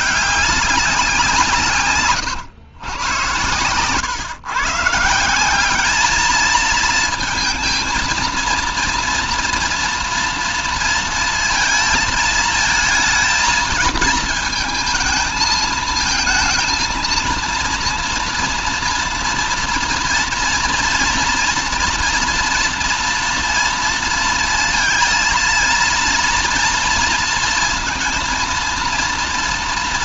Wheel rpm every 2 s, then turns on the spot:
190, 120, 150, 220, 230, 230, 220, 220, 230, 230, 230, 230, 230, 230, 230.
none